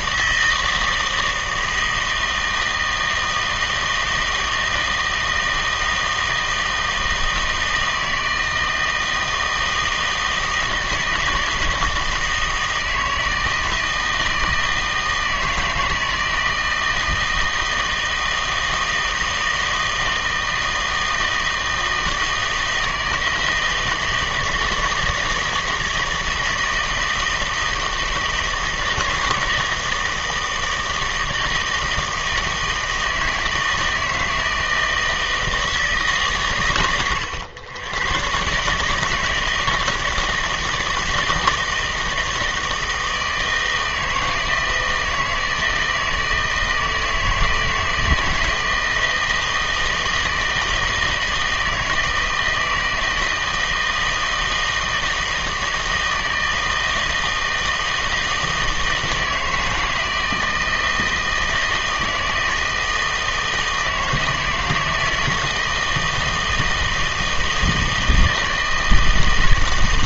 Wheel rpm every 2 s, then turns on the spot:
160, 160, 160, 160, 160, 160, 160, 160, 160, 160, 160, 160, 160, 160, 160, 160, 160, 160, 120, 140, 160, 160, 160, 160, 160, 160, 160, 160, 160, 160, 160, 160, 160, 160, 160.
none